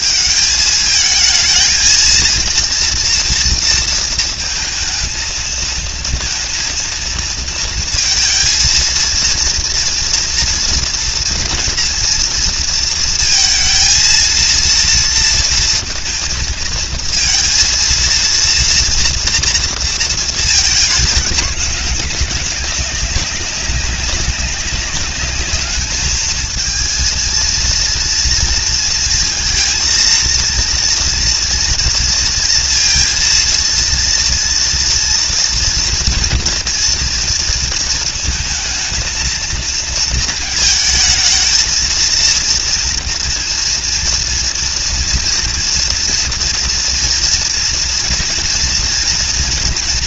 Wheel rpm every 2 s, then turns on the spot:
220, 230, 220, 230, 230, 230, 230, 230, 230, 230, 210, 200, 200, 230, 230, 230, 230, 230, 230, 230, 220, 230, 230, 240, 230.
none